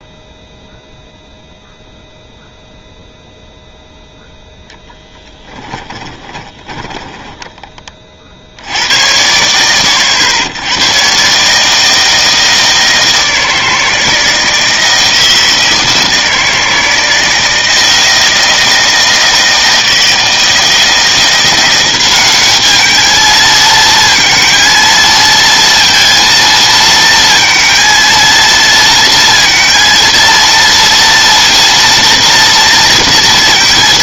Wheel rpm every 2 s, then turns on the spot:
0, 0, 10, 10, 90, 110, 160, 160, 160, 160, 160, 210, 230, 230, 230, 230, 230.
6-8